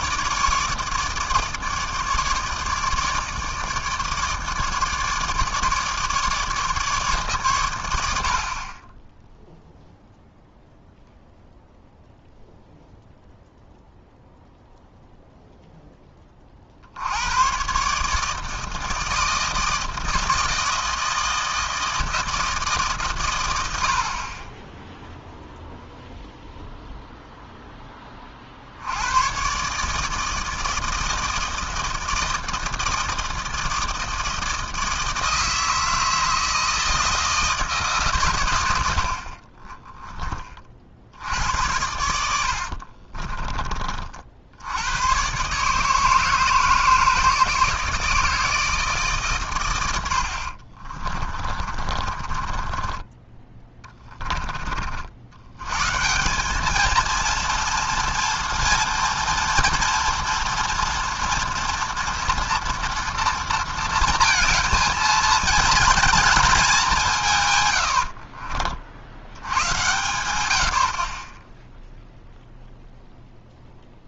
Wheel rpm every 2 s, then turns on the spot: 150, 150, 150, 150, 40, 0, 0, 0, 50, 160, 160, 150, 10, 0, 60, 160, 160, 160, 160, 100, 50, 50, 90, 160, 160, 50, 30, 40, 210, 230, 230, 230, 220, 200, 40, 80, 0.
42-44 50-54